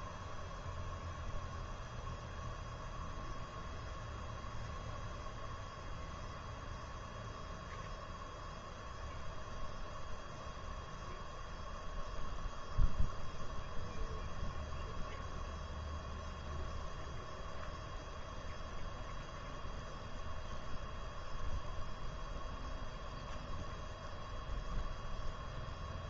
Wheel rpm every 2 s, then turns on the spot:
0, 0, 0, 0, 0, 0, 0, 0, 0, 0, 0, 0, 0.
none